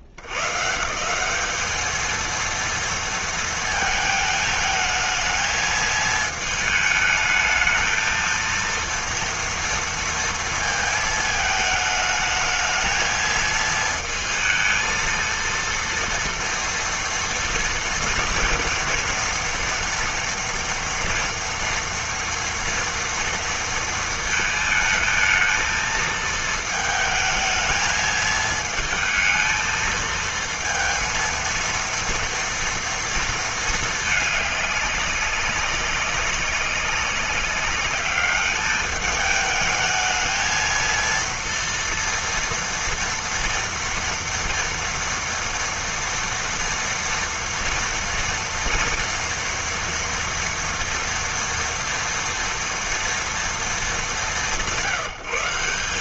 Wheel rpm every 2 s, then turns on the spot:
60, 230, 220, 220, 230, 230, 220, 220, 230, 230, 240, 230, 220, 220, 220, 230, 230, 210, 190, 210, 220, 230, 230, 230, 230, 230, 230, 150.
none